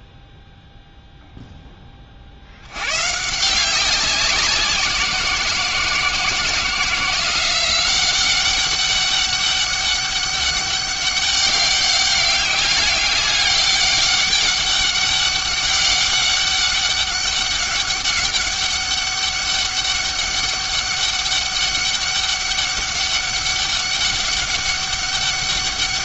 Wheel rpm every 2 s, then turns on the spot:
0, 100, 180, 170, 190, 200, 200, 200, 200, 200, 200, 200, 200.
none